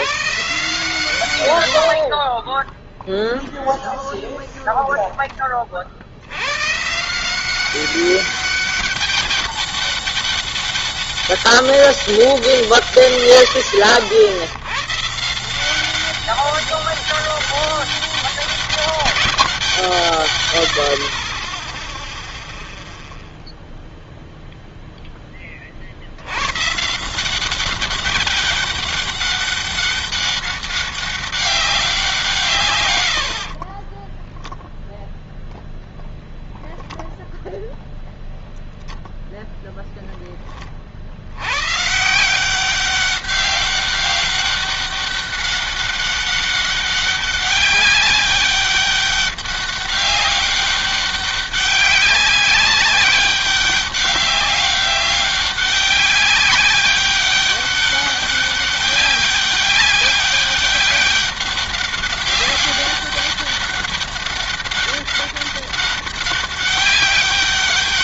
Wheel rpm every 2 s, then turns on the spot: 130, 50, 10, 110, 200, 200, 150, 80, 190, 200, 120, 0, 0, 90, 200, 200, 160, 10, 0, 0, 20, 170, 190, 200, 200, 200, 200, 190, 200, 200, 200, 200, 200, 200.
2-4